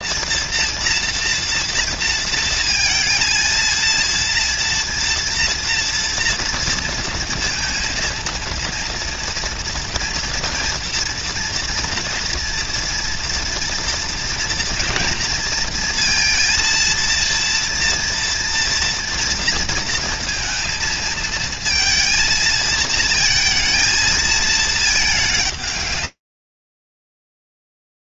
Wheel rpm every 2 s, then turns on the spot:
230, 230, 230, 230, 230, 230, 230, 230, 230, 240, 230, 230, 220, 120.
none